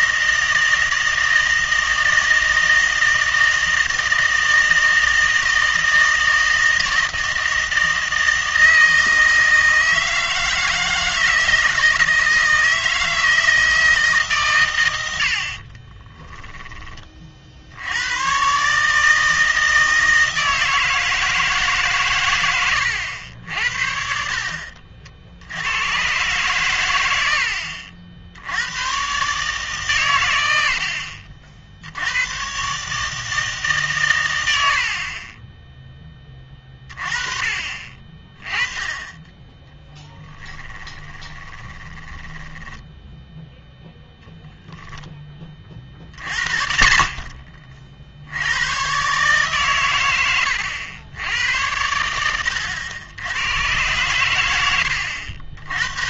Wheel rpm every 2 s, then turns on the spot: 160, 160, 160, 160, 160, 160, 160, 110, 20, 140, 160, 100, 50, 110, 100, 70, 140, 70, 30, 20, 10, 10, 0, 60, 110, 90, 90, 110.
24-26 40-44